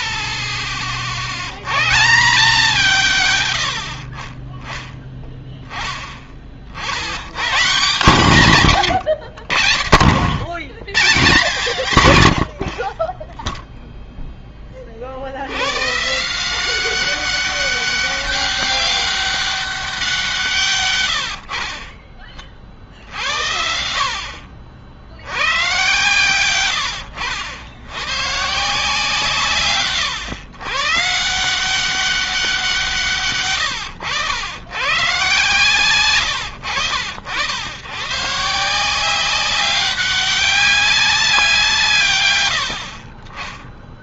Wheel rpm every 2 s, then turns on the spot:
20, 160, 30, 30, 160, 90, 90, 10, 170, 200, 160, 40, 50, 110, 140, 130, 180, 100, 90, 150, 200, 100.
none